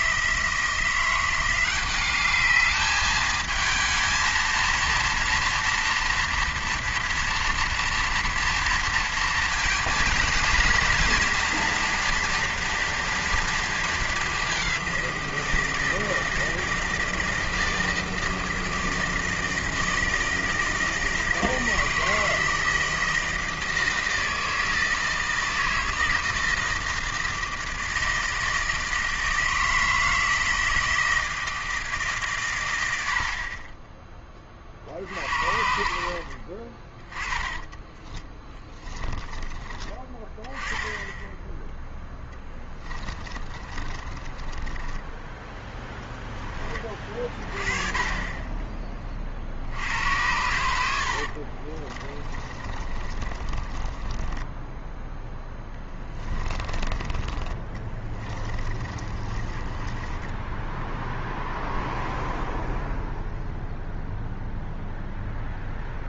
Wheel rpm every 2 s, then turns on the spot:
170, 210, 230, 230, 230, 230, 240, 200, 160, 160, 160, 160, 160, 160, 160, 160, 110, 40, 50, 20, 10, 20, 20, 20, 20, 90, 30, 10, 20, 20, 10, 0, 0.
38-40 42-46 52-62